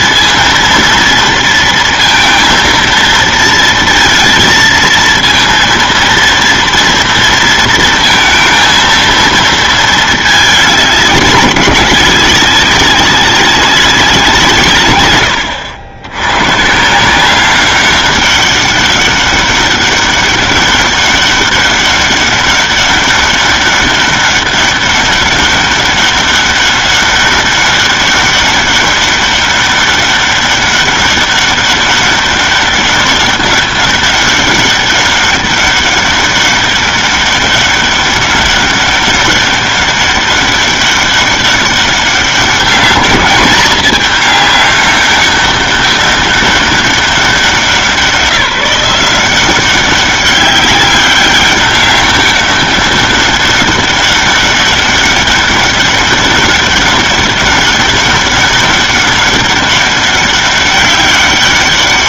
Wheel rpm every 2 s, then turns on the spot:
230, 230, 230, 230, 230, 210, 190, 160, 120, 200, 200, 200, 200, 200, 200, 200, 200, 200, 200, 200, 200, 200, 200, 200, 180, 200, 200, 200, 200, 200, 200.
none